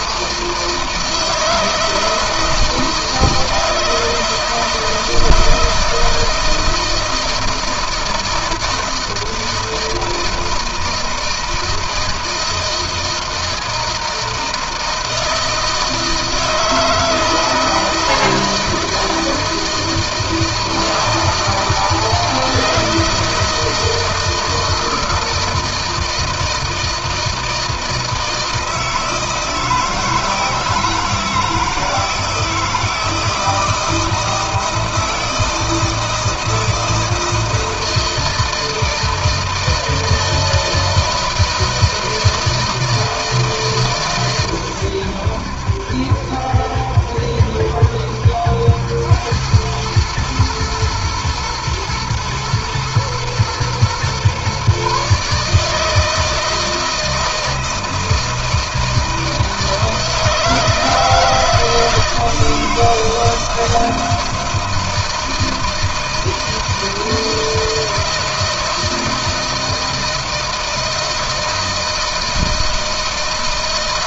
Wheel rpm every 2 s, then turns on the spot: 160, 160, 160, 160, 160, 160, 160, 160, 160, 160, 160, 160, 160, 160, 160, 160, 160, 160, 160, 160, 160, 160, 100, 70, 90, 110, 110, 140, 160, 160, 160, 160, 160, 160, 160, 160, 160.
none